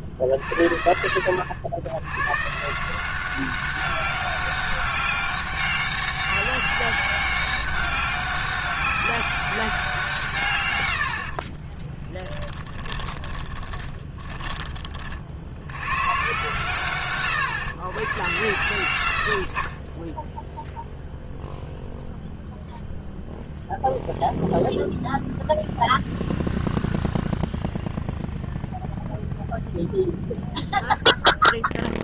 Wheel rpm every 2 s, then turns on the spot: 60, 160, 200, 200, 200, 120, 20, 20, 130, 100, 0, 0, 0, 0, 0, 0.
12-16